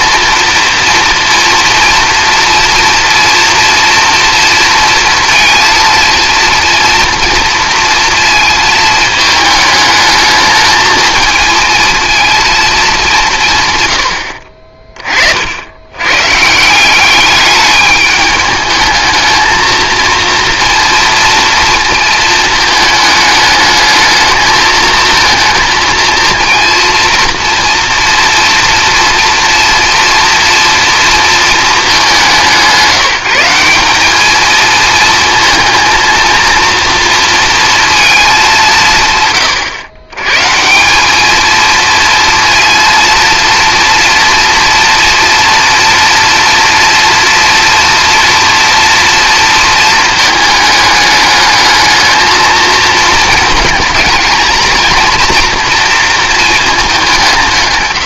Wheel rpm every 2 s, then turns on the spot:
230, 230, 230, 230, 220, 220, 210, 40, 170, 220, 230, 220, 220, 230, 230, 230, 180, 230, 230, 180, 170, 230, 230, 230, 230, 210, 220, 230, 210.
14-16